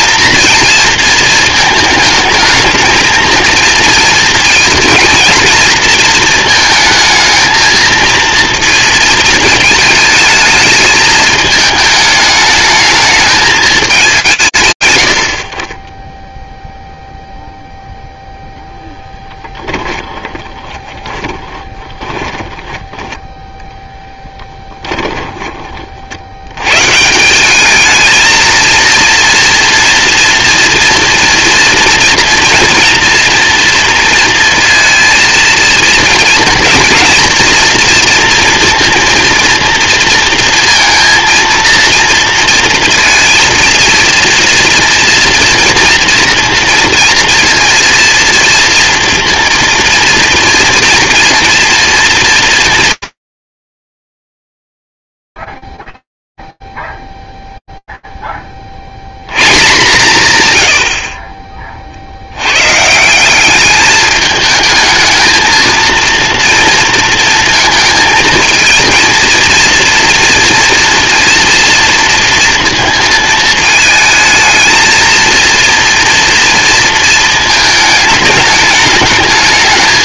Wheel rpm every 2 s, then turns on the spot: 230, 220, 230, 220, 230, 220, 220, 90, 0, 10, 20, 10, 20, 170, 240, 230, 230, 230, 240, 230, 230, 230, 230, 230, 230, 230, 230, 70, 0, 50, 90, 140, 220, 230, 230, 240, 230, 220, 230, 210.
18-24